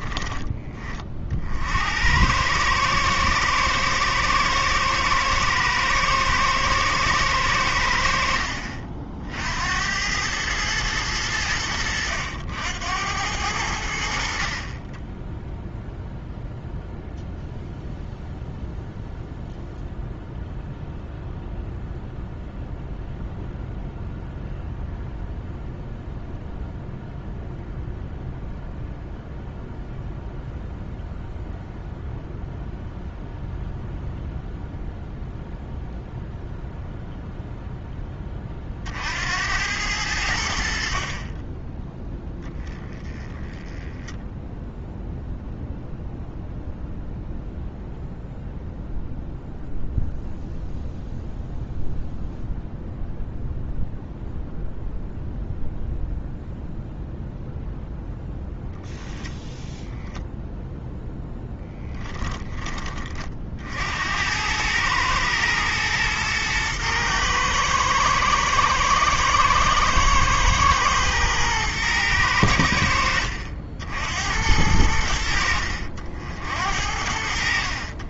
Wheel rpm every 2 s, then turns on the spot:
20, 110, 110, 110, 50, 110, 80, 20, 0, 0, 0, 0, 0, 0, 0, 0, 0, 0, 0, 50, 60, 10, 0, 0, 0, 0, 0, 0, 0, 0, 0, 20, 110, 120, 120, 120, 80, 90, 70.
none